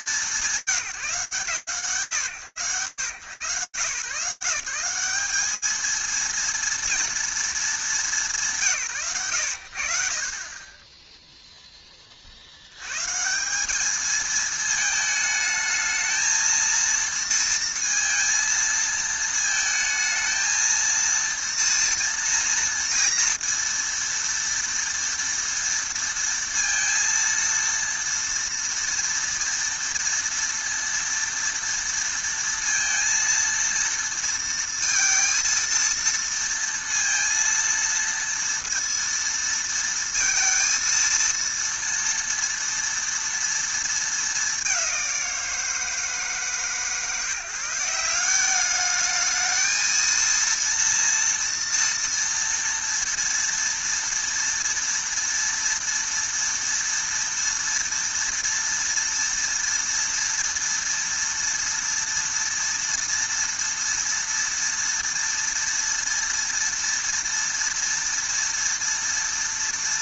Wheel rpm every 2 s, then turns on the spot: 120, 150, 210, 220, 100, 20, 210, 220, 230, 220, 230, 230, 230, 230, 230, 230, 230, 230, 230, 230, 230, 220, 160, 170, 230, 230, 230, 230, 230, 230, 230, 230, 230, 230, 230.
none